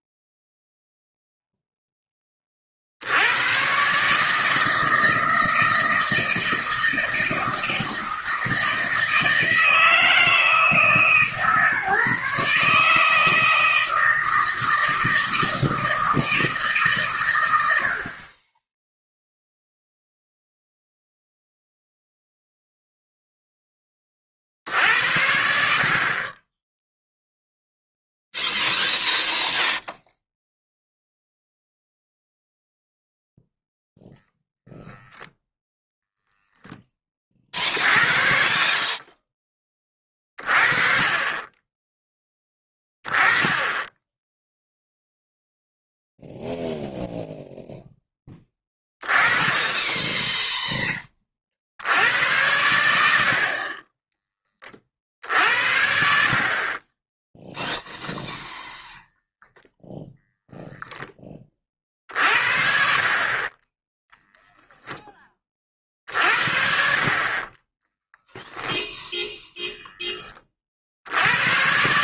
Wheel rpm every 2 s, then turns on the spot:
0, 40, 160, 160, 160, 160, 150, 160, 160, 20, 0, 0, 50, 20, 0, 0, 0, 0, 10, 40, 30, 10, 0, 0, 10, 10, 100, 30, 40, 0, 0, 50, 0, 60, 0, 30.
none